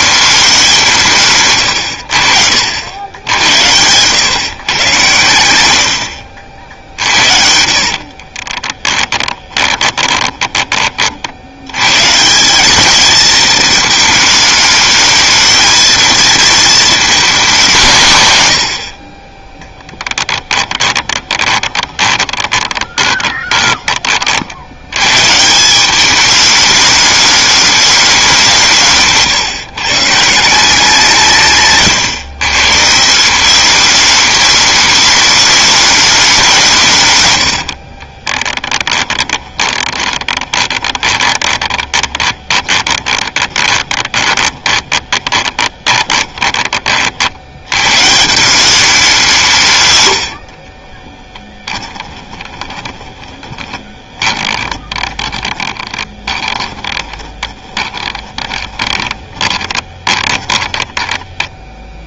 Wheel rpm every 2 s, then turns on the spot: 200, 80, 130, 60, 30, 20, 190, 220, 230, 90, 10, 20, 70, 210, 170, 170, 130, 210, 180, 20, 20, 20, 20, 20, 190, 50, 20, 20, 20, 20, 20.
6-10 20-24 38-46 52-62